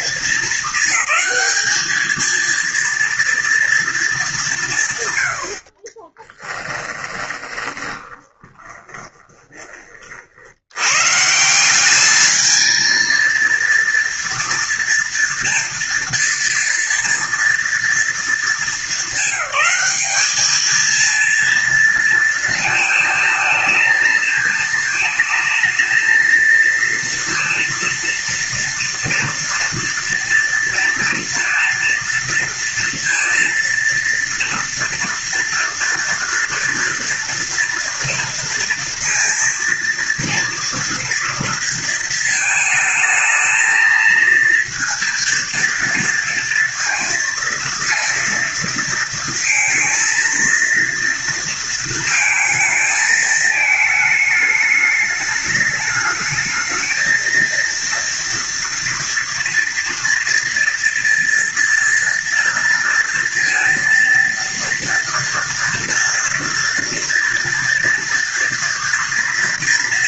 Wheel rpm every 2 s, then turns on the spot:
200, 230, 120, 20, 20, 140, 230, 240, 230, 210, 230, 220, 220, 230, 230, 230, 230, 230, 230, 230, 230, 220, 230, 230, 230, 230, 220, 210, 230, 230, 230, 230, 240, 230, 230.
6-10